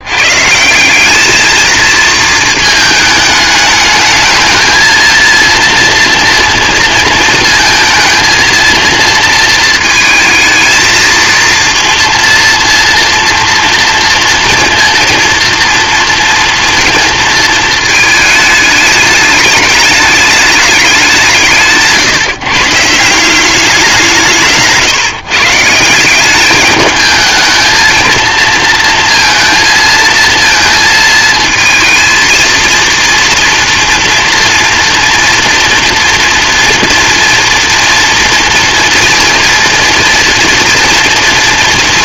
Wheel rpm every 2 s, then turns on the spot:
160, 220, 220, 230, 230, 220, 230, 230, 230, 210, 210, 150, 160, 210, 230, 230, 230, 230, 230, 230, 230.
24-26